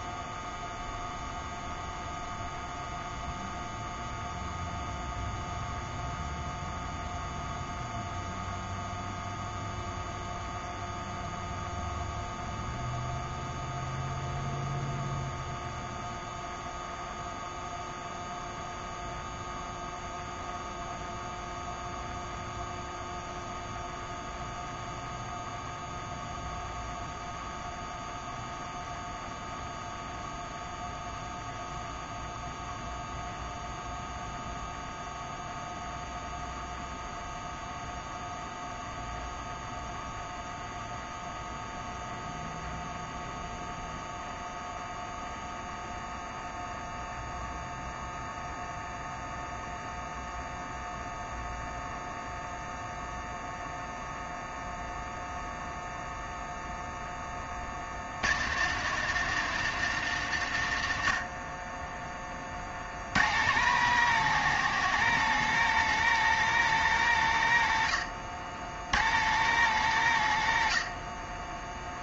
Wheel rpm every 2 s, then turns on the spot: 0, 0, 0, 0, 0, 0, 0, 0, 0, 0, 0, 0, 0, 0, 0, 0, 0, 0, 0, 0, 0, 0, 0, 0, 0, 0, 0, 0, 10, 150, 70, 90, 180, 150, 110, 40.
none